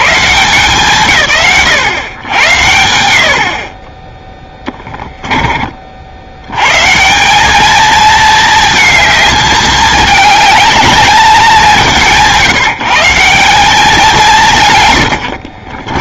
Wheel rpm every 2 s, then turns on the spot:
70, 70, 10, 120, 220, 220, 150, 140.
4-6